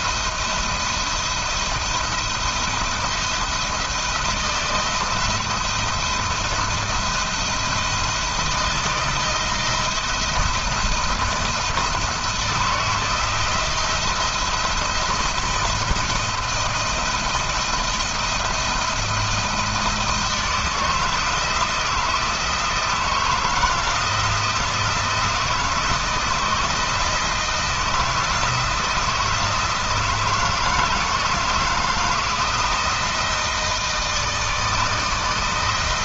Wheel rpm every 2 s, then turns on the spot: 170, 170, 170, 170, 170, 170, 170, 170, 170, 170, 160, 160, 170, 160, 160, 160, 170, 160.
none